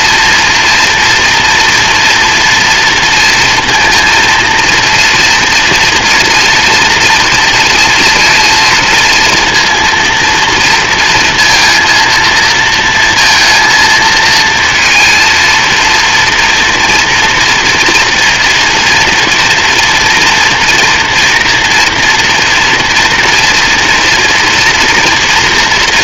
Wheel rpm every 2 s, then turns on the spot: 230, 230, 230, 240, 230, 230, 230, 230, 230, 230, 230, 240, 230.
none